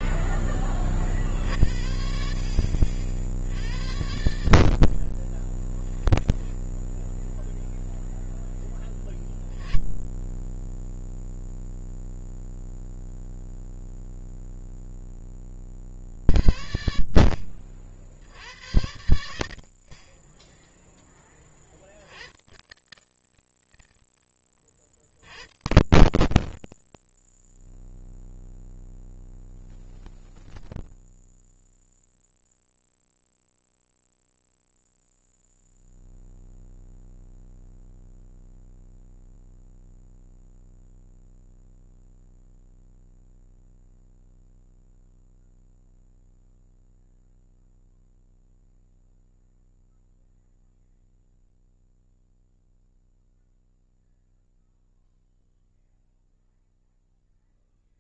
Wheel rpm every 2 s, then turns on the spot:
40, 60, 50, 0, 20, 0, 0, 20, 60, 70, 20, 130, 80, 120, 0, 0, 0, 0, 0, 0, 0, 0, 0, 0, 0, 0, 0, 0, 0.
8-10